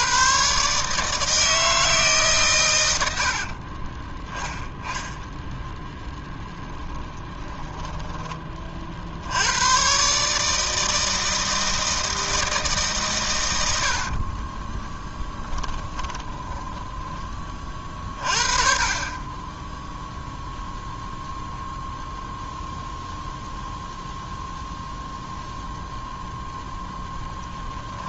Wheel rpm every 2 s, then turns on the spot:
140, 100, 10, 10, 40, 160, 150, 20, 20, 30, 0, 0, 0, 0.
4-8 14-16